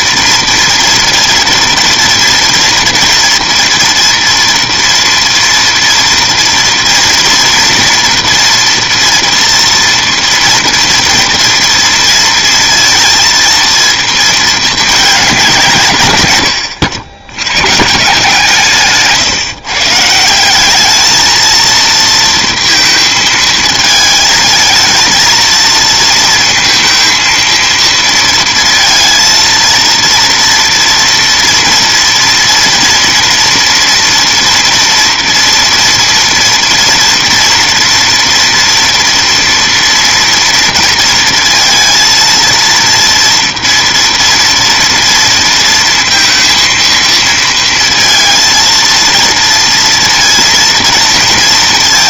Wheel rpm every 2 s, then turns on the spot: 240, 230, 230, 230, 230, 230, 230, 220, 100, 160, 200, 230, 220, 230, 230, 230, 230, 230, 230, 230, 230, 230, 230, 230, 230, 230.
16-18